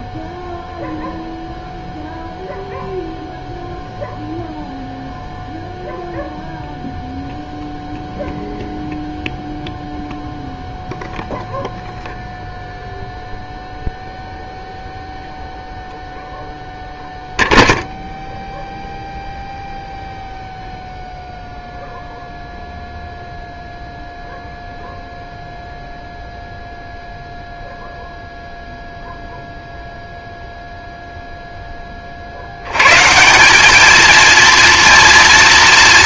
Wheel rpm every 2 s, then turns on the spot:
0, 0, 0, 0, 0, 0, 0, 0, 0, 0, 0, 0, 0, 0, 0, 0, 100, 230.
none